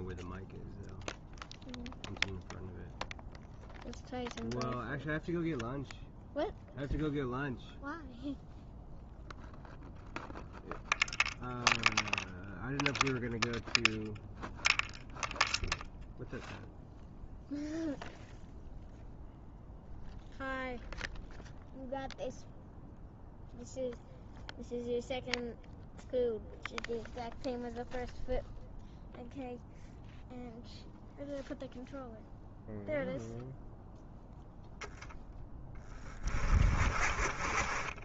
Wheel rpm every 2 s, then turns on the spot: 0, 0, 0, 0, 0, 0, 0, 0, 0, 0, 0, 0, 0, 0, 0, 0, 0, 0, 40.
none